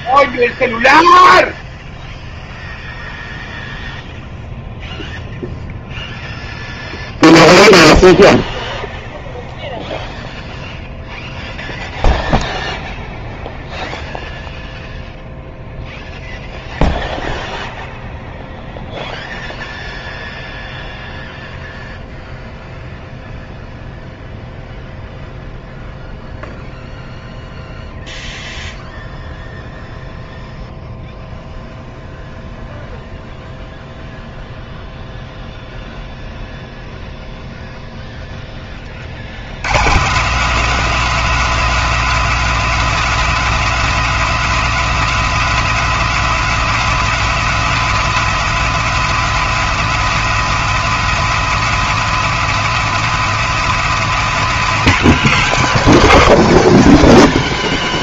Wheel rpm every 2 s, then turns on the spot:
0, 0, 0, 0, 0, 0, 0, 0, 0, 0, 0, 0, 0, 0, 0, 0, 0, 0, 0, 10, 220, 240, 240, 240, 240, 240, 240, 200, 170.
none